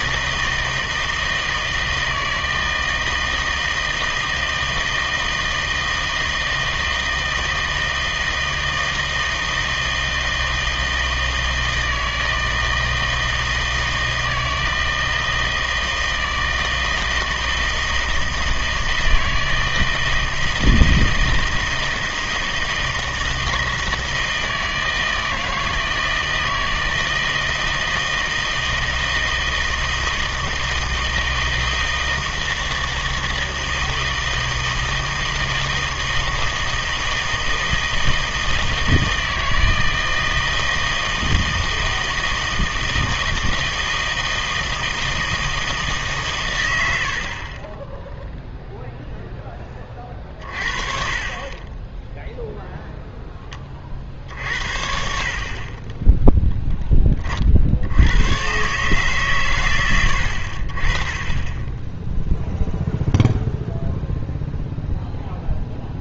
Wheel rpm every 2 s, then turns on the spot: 160, 160, 160, 160, 160, 160, 160, 160, 160, 160, 160, 160, 160, 160, 160, 160, 160, 160, 160, 160, 160, 160, 160, 110, 0, 30, 0, 60, 10, 130, 50, 0, 0.
none